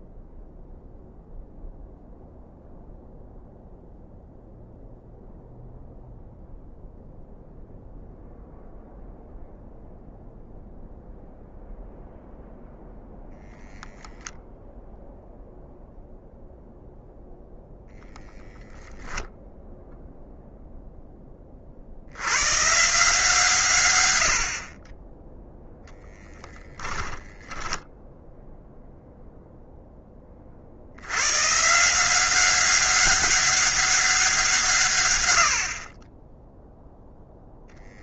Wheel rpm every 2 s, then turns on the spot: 0, 0, 0, 0, 0, 0, 0, 0, 0, 0, 0, 160, 50, 20, 0, 50, 200, 150, 0.
26-28